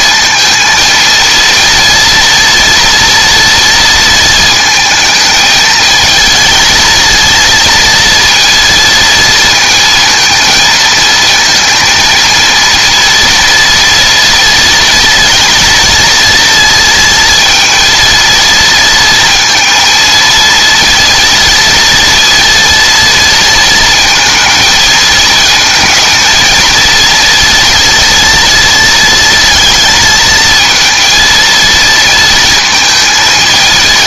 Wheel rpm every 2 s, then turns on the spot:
230, 230, 220, 220, 230, 220, 230, 230, 230, 230, 230, 230, 230, 230, 230, 230, 230.
none